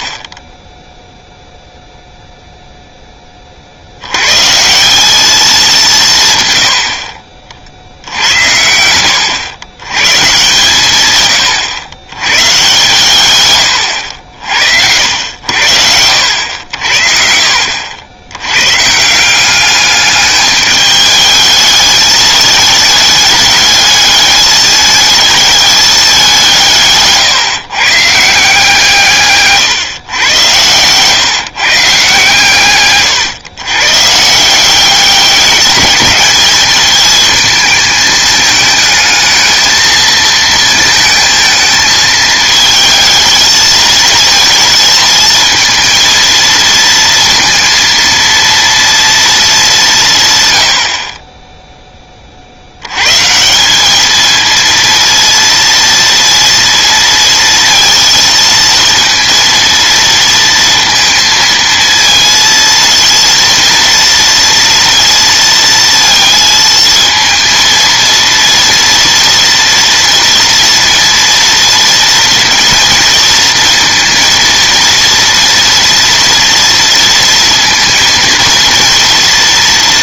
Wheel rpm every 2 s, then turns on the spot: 0, 0, 180, 90, 80, 120, 130, 80, 60, 160, 210, 210, 220, 150, 150, 120, 120, 190, 220, 220, 220, 220, 220, 230, 230, 40, 110, 230, 230, 230, 230, 230, 230, 230, 230, 230, 230, 230, 230, 230.
none